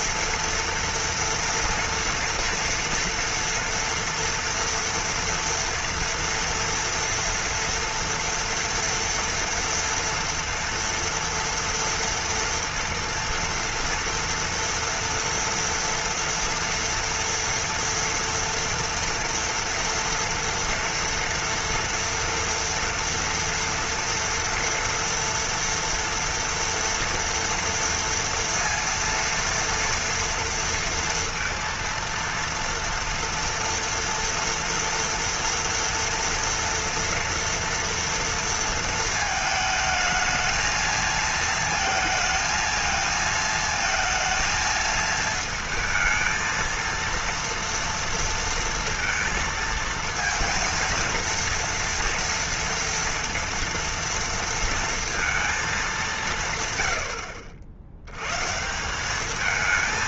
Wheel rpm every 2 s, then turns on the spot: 230, 230, 230, 230, 230, 230, 230, 230, 240, 230, 230, 230, 230, 230, 230, 230, 230, 230, 230, 230, 220, 220, 220, 220, 230, 230, 230, 230, 140, 140.
none